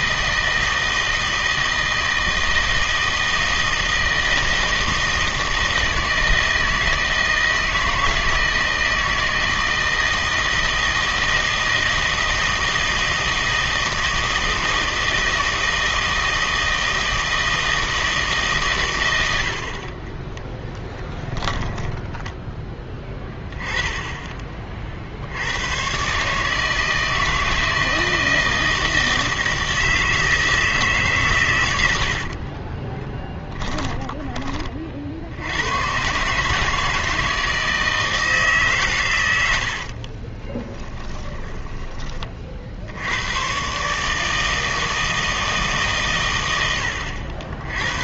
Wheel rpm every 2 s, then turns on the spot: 160, 160, 160, 160, 160, 160, 160, 160, 160, 130, 10, 10, 30, 150, 160, 160, 40, 40, 150, 140, 20, 60, 160, 100.
20-22 32-34 40-42